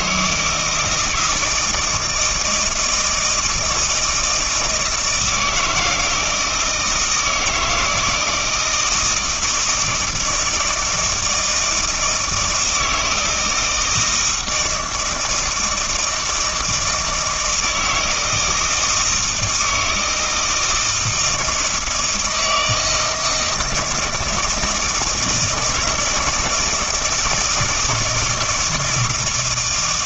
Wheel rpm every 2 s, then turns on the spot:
160, 160, 160, 160, 160, 160, 160, 160, 160, 160, 160, 160, 160, 160, 170.
none